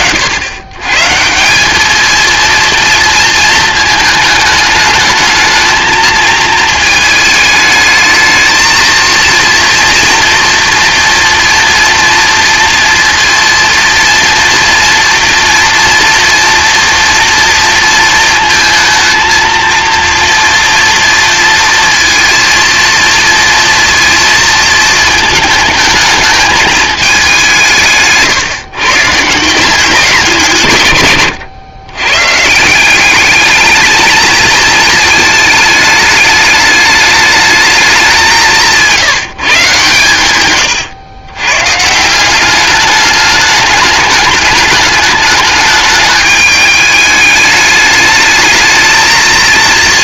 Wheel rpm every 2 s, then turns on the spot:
140, 230, 210, 220, 230, 230, 230, 230, 230, 220, 230, 230, 230, 210, 150, 140, 190, 220, 210, 160, 120, 210, 210, 210, 220.
none